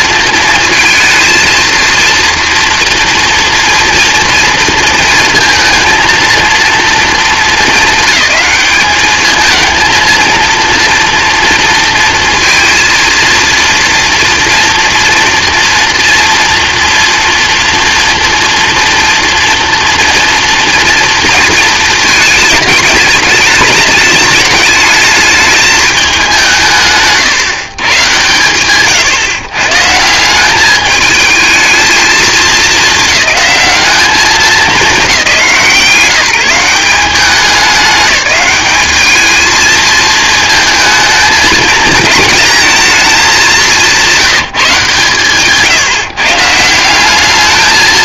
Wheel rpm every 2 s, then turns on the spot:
230, 230, 230, 220, 200, 230, 230, 230, 230, 240, 230, 210, 210, 170, 130, 210, 210, 170, 170, 210, 220, 220, 160, 170.
none